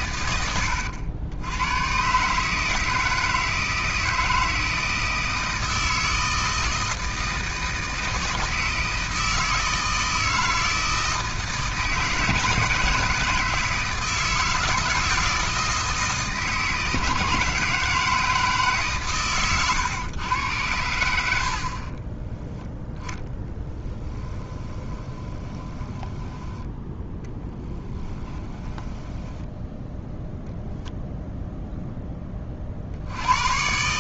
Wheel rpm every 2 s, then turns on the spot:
90, 160, 160, 160, 160, 160, 160, 160, 160, 140, 80, 0, 20, 10, 10, 0, 60.
24-26 28-30